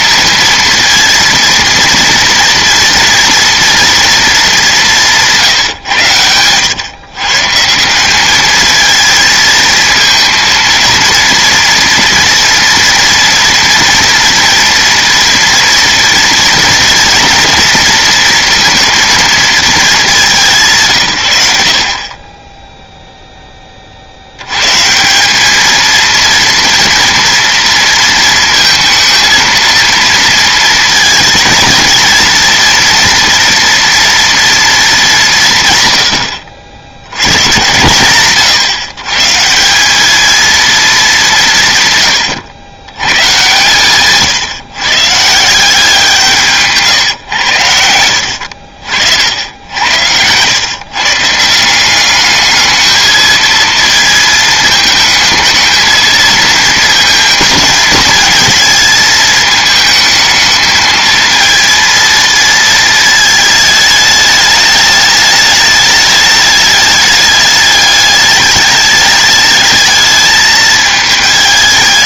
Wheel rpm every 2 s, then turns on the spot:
230, 230, 180, 120, 220, 230, 230, 230, 230, 230, 140, 0, 130, 230, 230, 220, 230, 230, 80, 130, 230, 110, 130, 150, 60, 130, 210, 220, 220, 220, 220, 220, 210, 210, 210, 220.
46-48